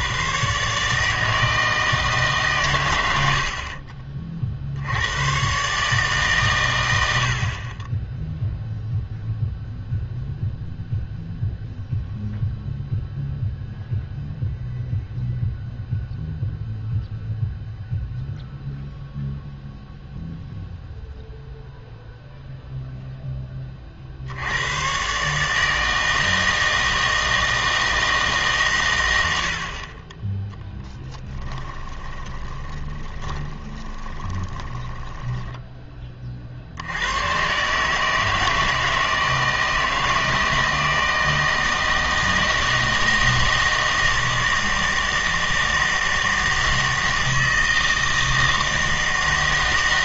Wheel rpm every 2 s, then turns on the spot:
130, 120, 50, 110, 0, 0, 0, 0, 0, 0, 0, 0, 90, 160, 140, 10, 20, 20, 60, 160, 160, 160, 160, 160, 160.
32-36